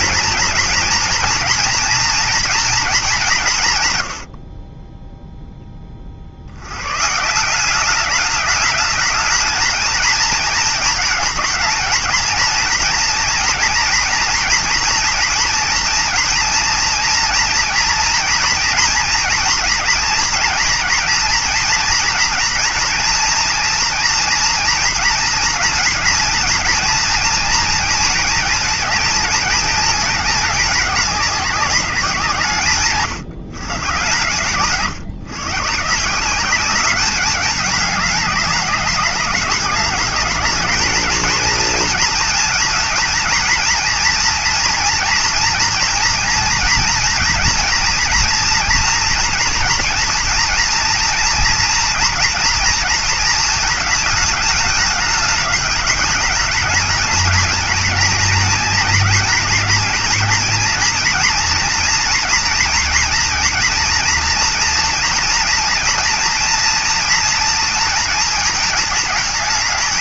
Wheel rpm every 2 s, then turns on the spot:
240, 190, 10, 140, 210, 220, 230, 230, 230, 230, 230, 240, 230, 230, 220, 210, 120, 130, 200, 200, 220, 230, 230, 230, 230, 230, 230, 210, 220, 230, 230, 230, 230, 230, 220.
none